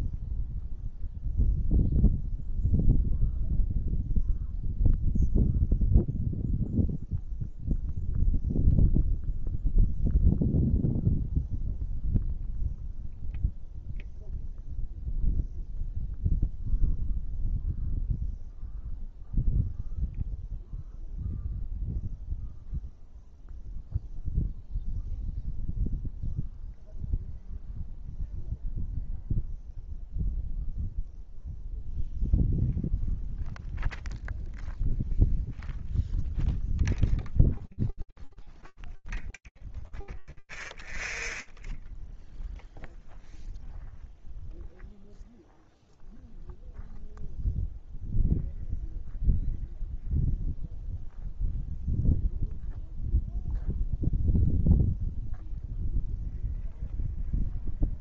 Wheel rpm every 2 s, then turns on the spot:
0, 0, 0, 0, 0, 0, 0, 0, 0, 0, 0, 0, 0, 0, 0, 0, 0, 0, 0, 0, 0, 0, 0, 0, 0, 0, 0, 0, 0.
none